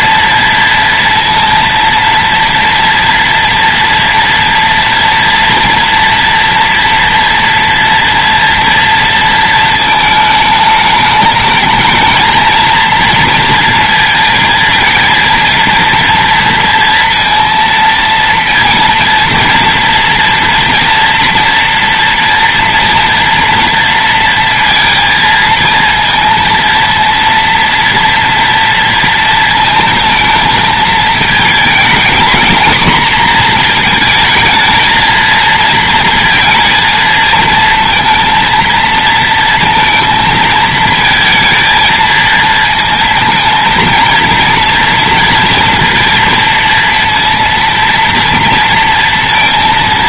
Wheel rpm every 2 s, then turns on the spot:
230, 230, 230, 230, 230, 220, 230, 230, 230, 230, 230, 230, 230, 230, 230, 230, 230, 220, 230, 230, 220, 230, 240, 230, 230.
none